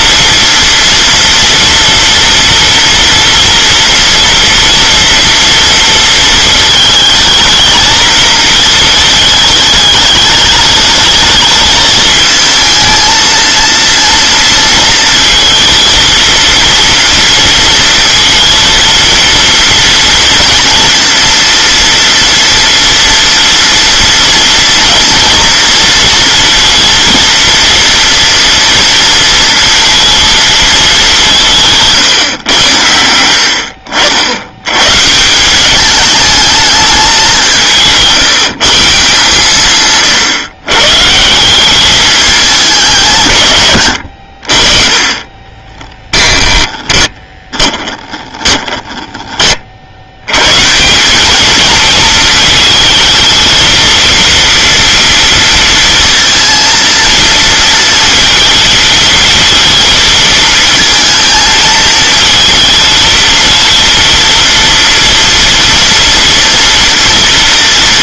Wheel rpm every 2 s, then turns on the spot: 240, 230, 230, 220, 230, 220, 230, 230, 230, 230, 240, 230, 230, 230, 230, 220, 100, 110, 220, 160, 130, 190, 50, 10, 10, 130, 220, 230, 230, 230, 220, 220, 230, 230.
46-48